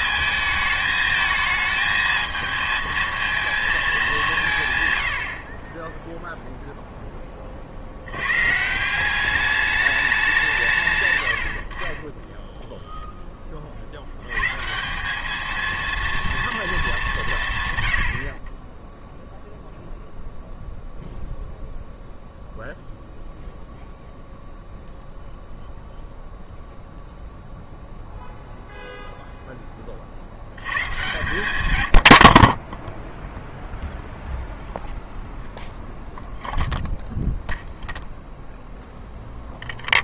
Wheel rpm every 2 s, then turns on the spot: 220, 220, 120, 0, 150, 150, 0, 160, 220, 20, 0, 0, 0, 0, 0, 100, 10, 0, 0, 0.
none